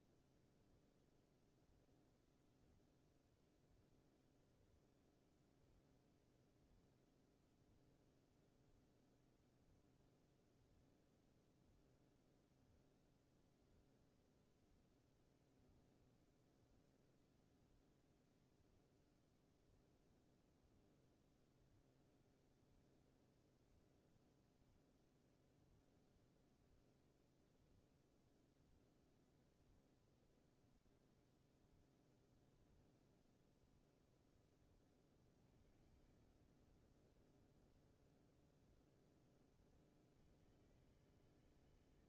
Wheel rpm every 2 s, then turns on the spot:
0, 0, 0, 0, 0, 0, 0, 0, 0, 0, 0, 0, 0, 0, 0, 0, 0, 10, 20, 0, 80.
36-38